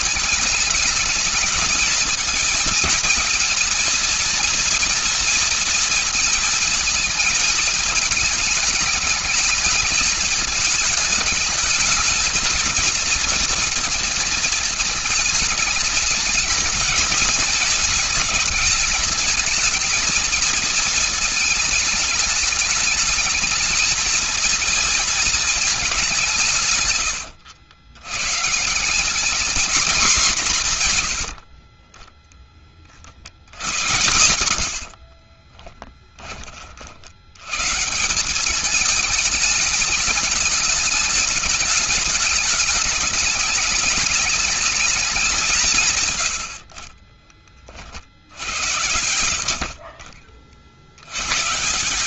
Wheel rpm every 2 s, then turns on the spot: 220, 230, 230, 210, 210, 220, 230, 220, 230, 220, 220, 220, 220, 80, 210, 50, 70, 50, 70, 210, 210, 210, 200, 50, 90, 70.
34-36 46-48